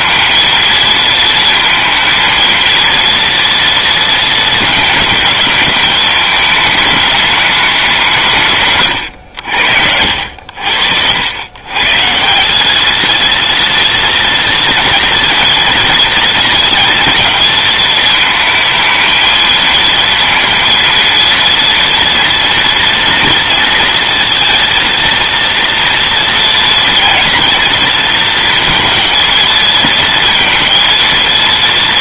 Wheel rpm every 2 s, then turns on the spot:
230, 230, 220, 210, 140, 70, 210, 230, 230, 220, 230, 230, 230, 230, 230, 230.
none